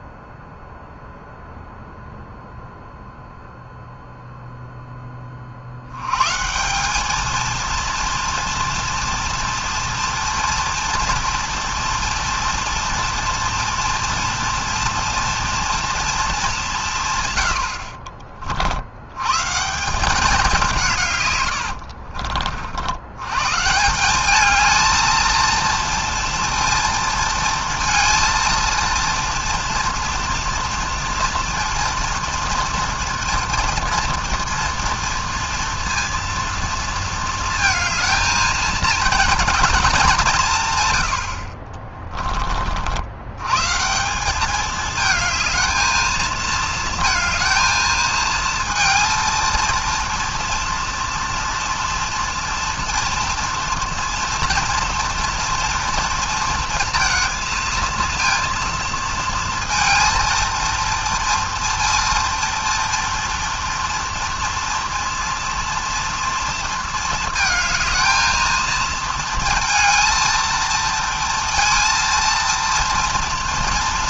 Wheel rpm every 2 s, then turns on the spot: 0, 0, 0, 180, 230, 230, 230, 230, 180, 70, 170, 70, 220, 230, 230, 230, 230, 230, 230, 230, 120, 50, 210, 220, 230, 230, 230, 230, 230, 230, 230, 230, 230, 230, 230, 230, 230.
none